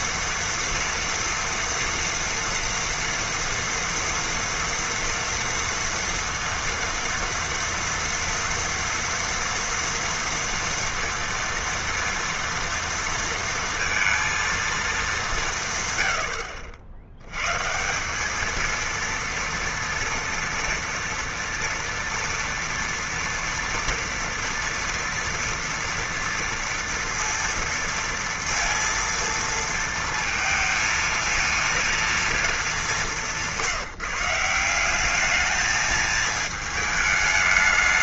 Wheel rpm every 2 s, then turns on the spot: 230, 230, 230, 230, 230, 230, 230, 200, 100, 230, 230, 230, 230, 230, 230, 230, 180, 210, 210.
none